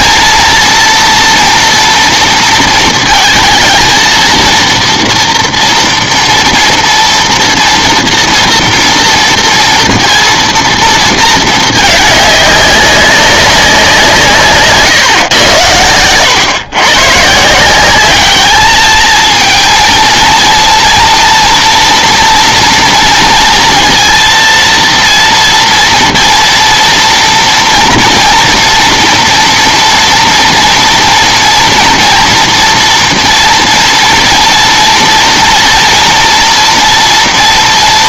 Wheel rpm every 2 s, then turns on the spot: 230, 230, 230, 230, 230, 230, 200, 150, 110, 210, 230, 230, 230, 230, 240, 230, 240, 230, 230.
none